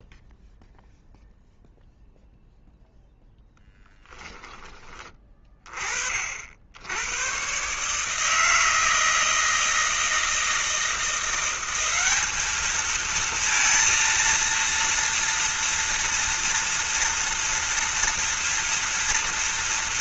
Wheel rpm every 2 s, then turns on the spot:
0, 0, 20, 80, 160, 170, 220, 230, 230, 230.
none